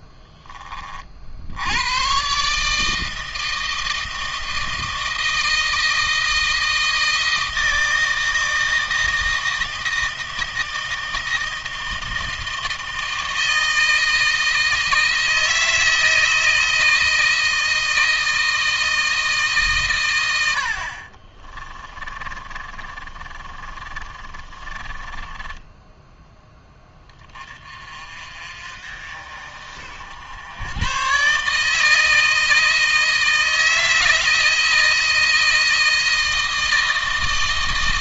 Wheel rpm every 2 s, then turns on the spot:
30, 150, 160, 160, 160, 160, 160, 160, 160, 160, 60, 30, 20, 10, 40, 100, 160, 160, 160.
20-26